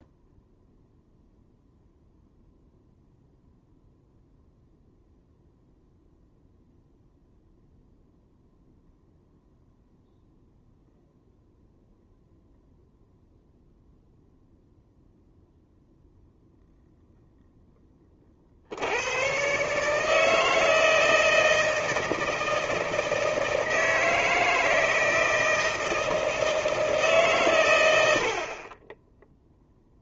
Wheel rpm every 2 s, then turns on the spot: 0, 0, 0, 0, 0, 0, 0, 0, 0, 60, 160, 160, 160, 160, 30.
none